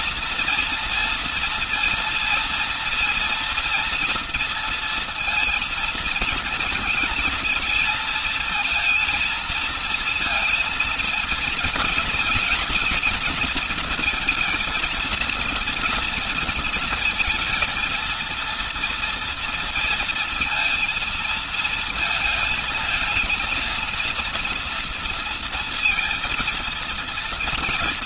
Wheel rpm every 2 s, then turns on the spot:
230, 230, 230, 230, 230, 230, 240, 230, 230, 230, 230, 220, 230, 230.
none